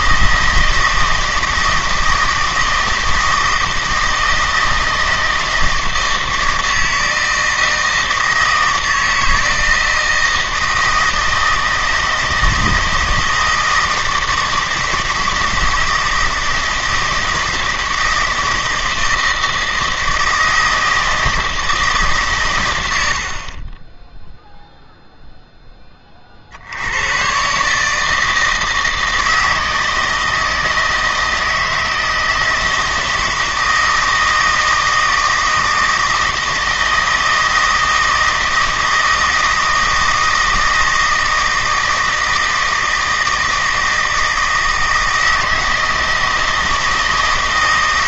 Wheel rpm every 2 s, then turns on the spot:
160, 160, 160, 160, 160, 160, 160, 160, 160, 160, 160, 100, 0, 80, 160, 160, 160, 160, 160, 160, 160, 160, 160, 160.
none